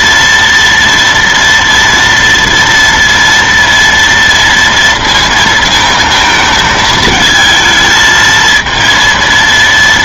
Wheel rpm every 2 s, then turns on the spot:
230, 230, 230, 220, 230.
none